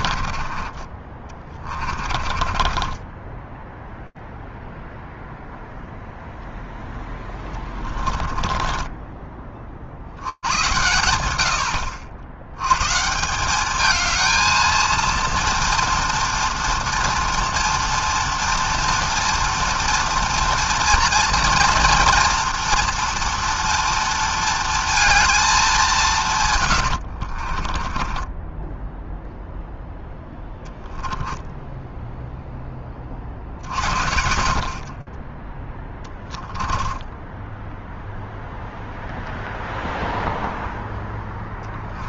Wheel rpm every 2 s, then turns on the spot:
30, 30, 0, 0, 20, 90, 100, 230, 230, 230, 230, 230, 230, 140, 20, 10, 0, 50, 10, 0, 0.
0-4 8-10 28-32 36-38